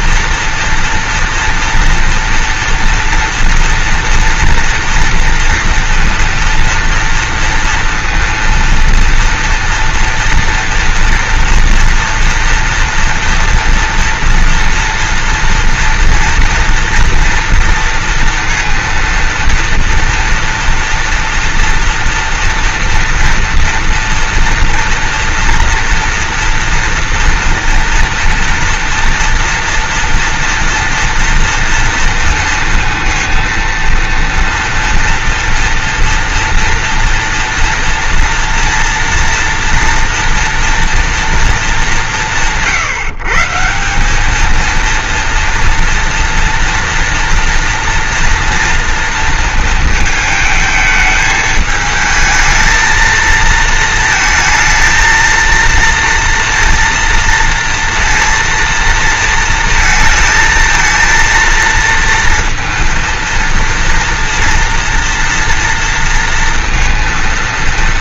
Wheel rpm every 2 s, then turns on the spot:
230, 230, 240, 230, 230, 230, 230, 230, 230, 230, 230, 230, 230, 240, 230, 240, 230, 230, 230, 230, 230, 140, 220, 230, 230, 220, 220, 230, 230, 230, 220, 230, 230, 230.
none